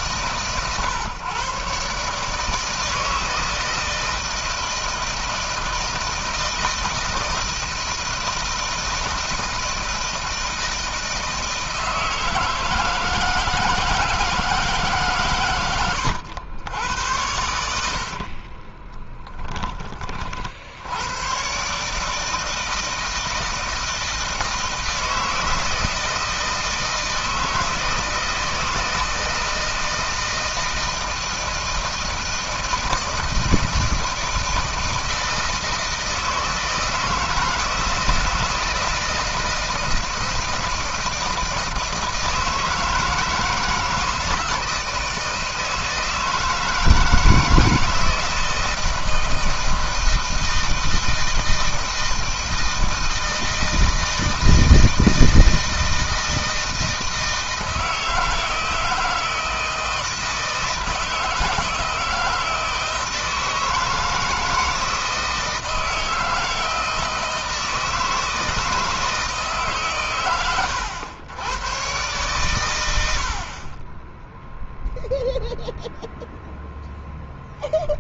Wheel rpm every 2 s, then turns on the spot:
120, 150, 160, 160, 160, 160, 160, 150, 90, 30, 70, 160, 160, 160, 160, 160, 160, 160, 160, 160, 160, 160, 160, 160, 160, 160, 160, 160, 160, 160, 160, 160, 160, 160, 160, 110, 100, 0, 0.
18-20